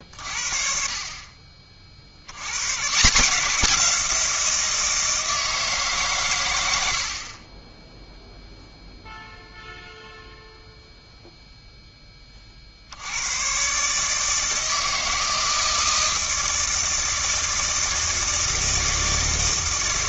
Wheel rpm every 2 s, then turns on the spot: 40, 110, 170, 100, 0, 0, 50, 160, 160, 160.
none